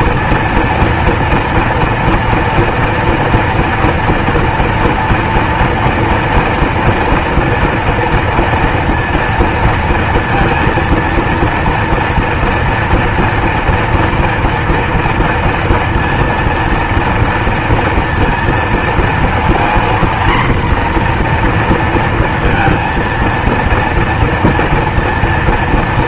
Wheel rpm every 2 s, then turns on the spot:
230, 230, 240, 230, 230, 230, 230, 230, 230, 230, 240, 230, 230.
none